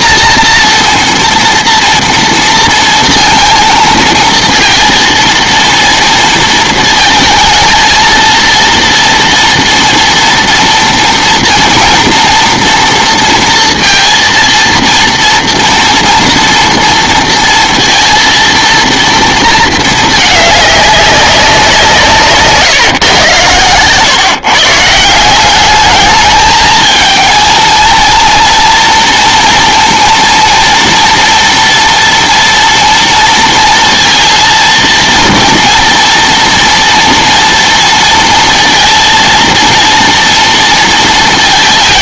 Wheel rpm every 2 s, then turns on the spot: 230, 230, 230, 220, 230, 230, 230, 230, 230, 230, 200, 140, 160, 220, 230, 230, 230, 230, 240, 230, 230.
none